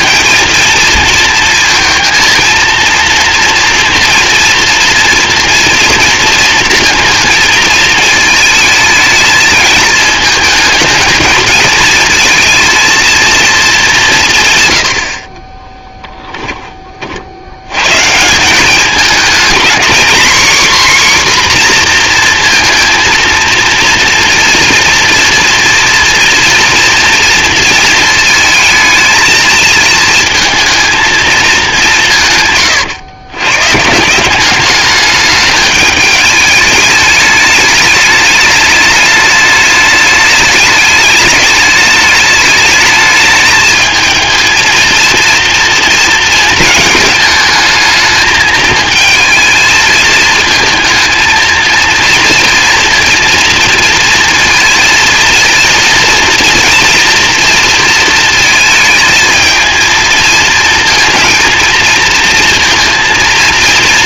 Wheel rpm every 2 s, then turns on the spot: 230, 230, 230, 230, 220, 210, 230, 110, 20, 200, 270, 230, 230, 230, 220, 220, 130, 200, 210, 210, 210, 210, 220, 230, 220, 220, 230, 230, 230, 220, 230, 230.
none